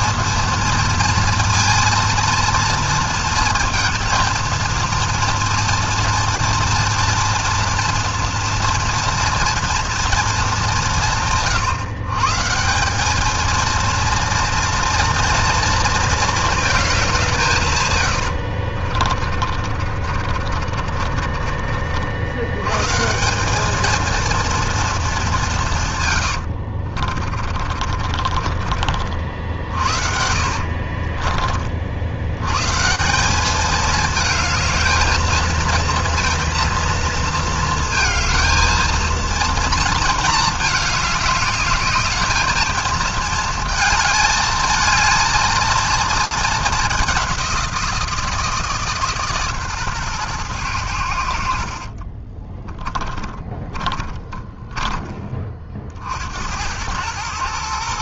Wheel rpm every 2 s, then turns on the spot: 230, 230, 230, 230, 230, 210, 140, 230, 220, 60, 40, 110, 230, 80, 30, 70, 120, 220, 230, 220, 220, 220, 220, 210, 160, 110, 20, 20, 80.
18-22 26-32 52-56